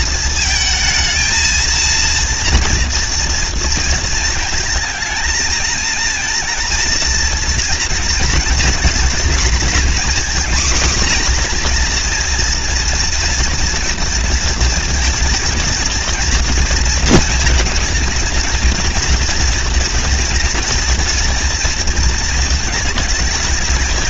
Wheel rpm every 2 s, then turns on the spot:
220, 230, 220, 230, 230, 240, 240, 230, 230, 230, 230, 230.
none